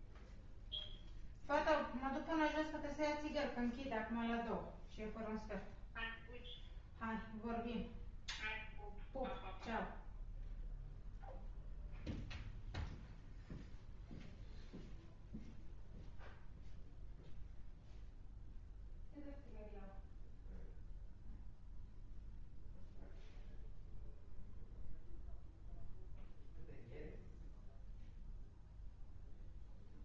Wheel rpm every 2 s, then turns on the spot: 0, 0, 0, 0, 0, 0, 0, 0, 0, 0, 0, 0, 0, 0, 0.
none